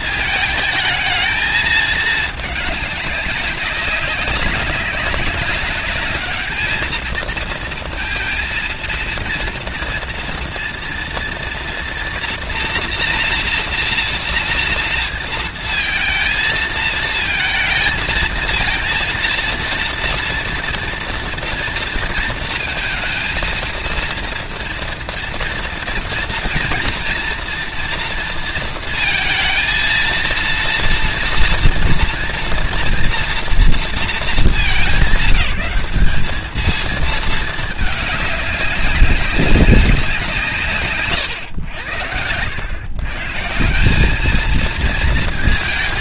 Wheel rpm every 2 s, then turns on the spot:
220, 200, 200, 220, 230, 230, 240, 230, 220, 230, 230, 230, 230, 230, 230, 230, 230, 190, 220, 200, 140, 140, 220.
none